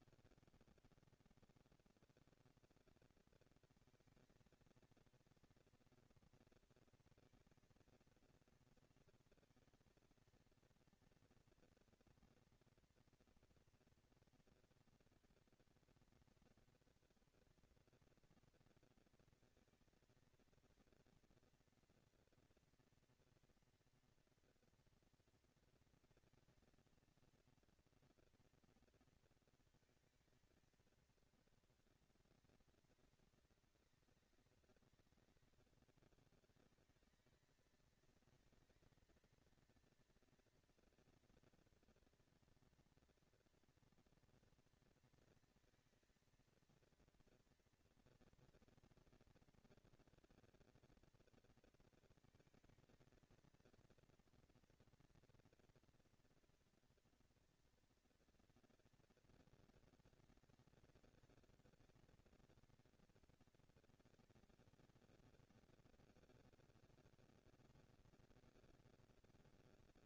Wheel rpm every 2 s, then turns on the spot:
170, 220, 230, 230, 230, 230, 230, 230, 230, 230, 230, 230, 230, 230, 230, 220, 200, 190, 210, 220, 230, 230, 230, 230, 230, 230, 220, 230, 240, 230, 230, 240, 230, 230, 220.
none